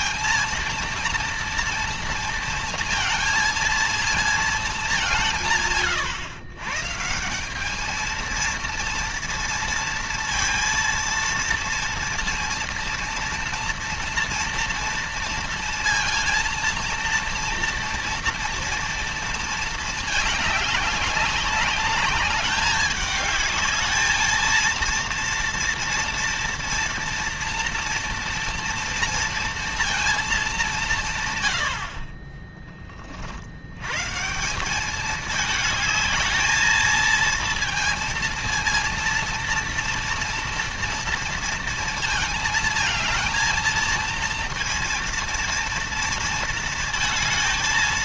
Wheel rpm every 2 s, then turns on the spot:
230, 230, 210, 130, 230, 230, 230, 230, 230, 230, 210, 210, 230, 230, 230, 190, 20, 180, 220, 230, 240, 220, 230, 230.
none